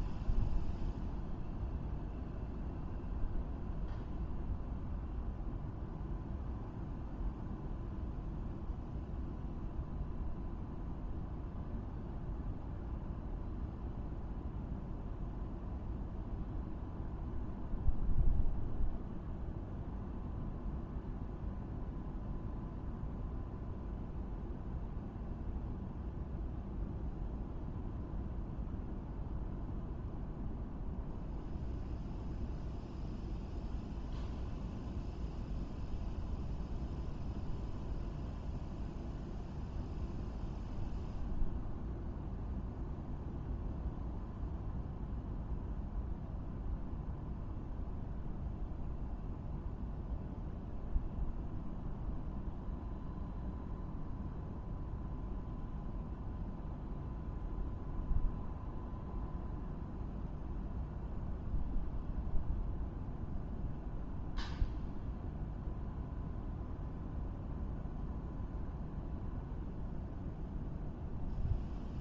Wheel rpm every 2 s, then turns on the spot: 0, 0, 0, 0, 0, 0, 0, 0, 0, 0, 0, 0, 0, 0, 0, 0, 0, 0, 0, 0, 0, 0, 0, 0, 0, 0, 0, 0, 0, 0, 0, 0, 0, 0, 0, 0.
none